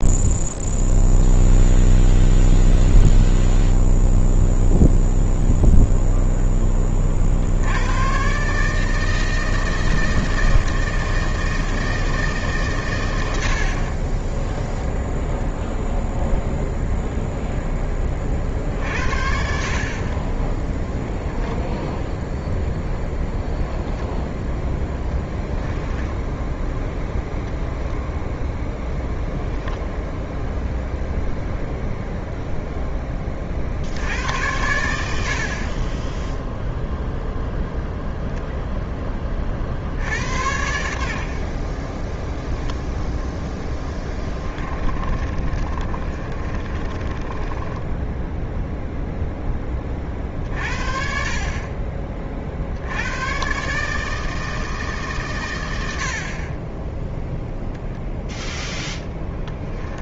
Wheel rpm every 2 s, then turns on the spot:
0, 0, 0, 30, 150, 160, 130, 0, 0, 50, 0, 0, 10, 10, 0, 0, 10, 80, 0, 10, 70, 0, 30, 30, 0, 50, 80, 150, 10, 10.
24-26 44-48 58-60